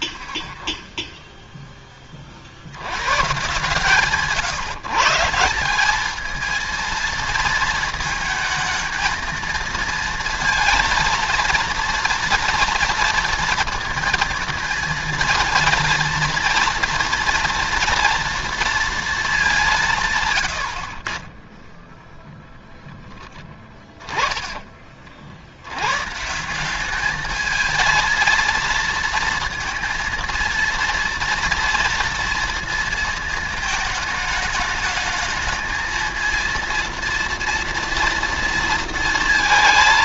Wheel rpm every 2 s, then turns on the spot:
20, 120, 160, 230, 220, 230, 230, 230, 230, 230, 60, 10, 40, 210, 230, 230, 220, 220, 230, 230.
22-24